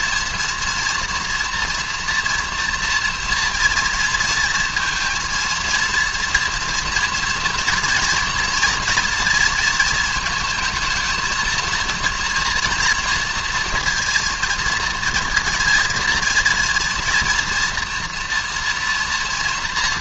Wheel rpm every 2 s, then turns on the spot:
240, 230, 230, 230, 230, 220, 230, 230, 240, 230.
none